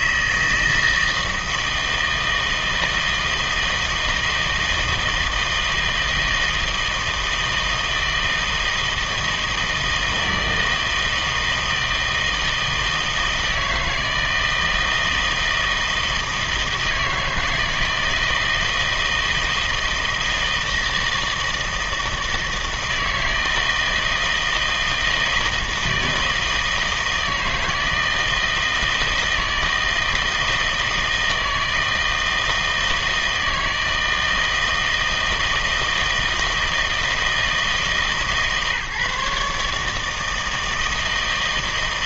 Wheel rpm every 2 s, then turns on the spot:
160, 160, 160, 160, 160, 160, 160, 160, 160, 160, 160, 160, 160, 160, 160, 160, 160, 160, 160, 140, 160.
none